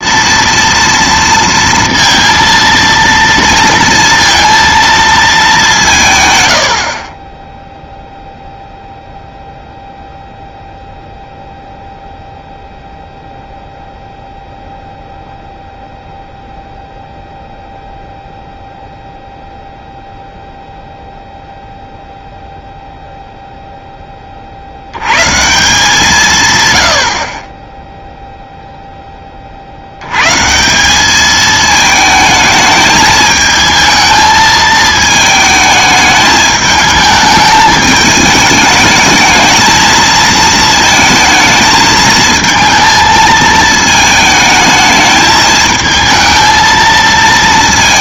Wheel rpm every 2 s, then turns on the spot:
230, 230, 230, 80, 0, 0, 0, 0, 0, 0, 0, 0, 70, 110, 0, 160, 220, 220, 220, 220, 220, 220, 220, 220.
none